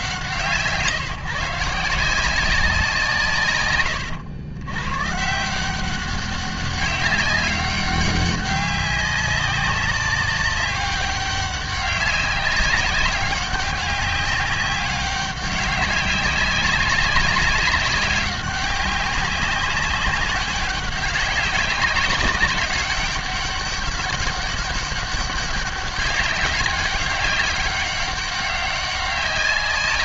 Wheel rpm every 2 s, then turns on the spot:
120, 180, 110, 200, 200, 200, 190, 200, 200, 190, 190, 200, 200, 200, 200.
none